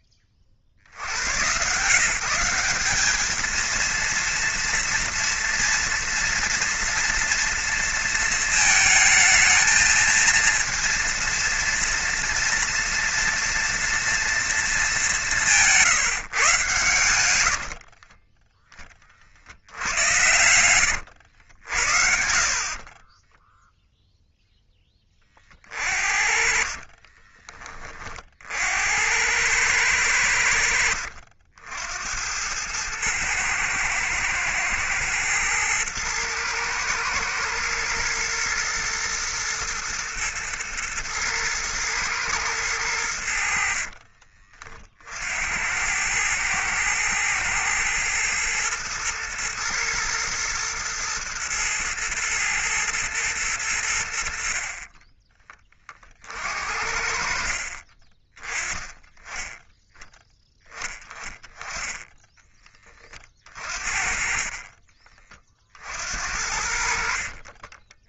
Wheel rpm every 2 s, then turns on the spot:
80, 200, 230, 240, 230, 230, 230, 210, 110, 30, 110, 30, 20, 30, 80, 70, 110, 110, 110, 120, 110, 100, 50, 110, 110, 110, 110, 30, 50, 20, 10, 20, 30, 60.
20-24 26-28 64-66